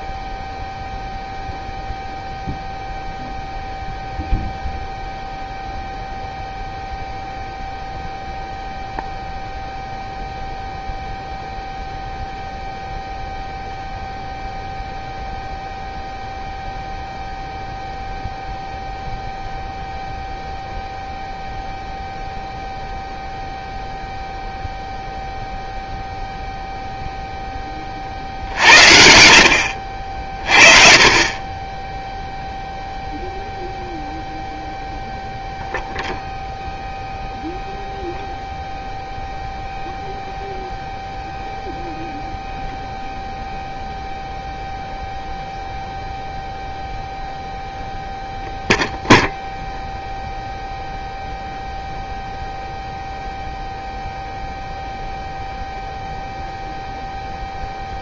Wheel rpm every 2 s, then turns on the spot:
0, 0, 0, 0, 0, 0, 0, 0, 0, 0, 0, 0, 0, 0, 60, 40, 0, 0, 0, 0, 0, 0, 0, 0, 0, 0, 0, 0, 0.
28-30